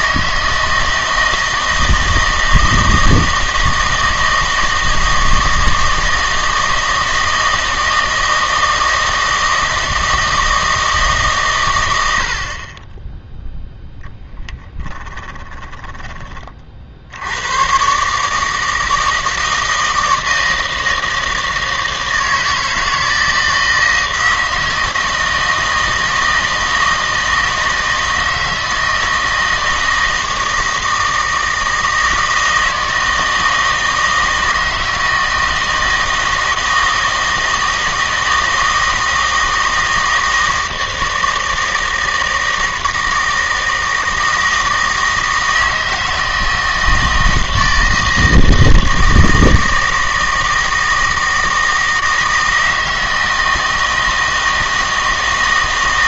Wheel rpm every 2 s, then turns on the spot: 160, 160, 160, 160, 160, 160, 30, 20, 50, 160, 160, 160, 160, 160, 160, 160, 160, 160, 160, 160, 160, 160, 160, 160, 160, 160, 160, 160.
14-16